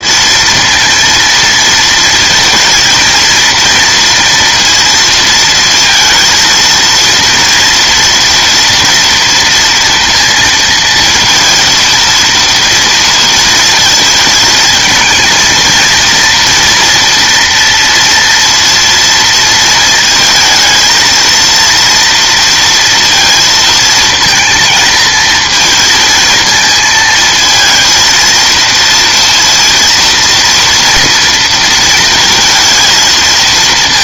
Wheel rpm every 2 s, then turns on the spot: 230, 230, 230, 230, 230, 230, 230, 220, 230, 230, 220, 230, 230, 220, 230, 230, 230.
none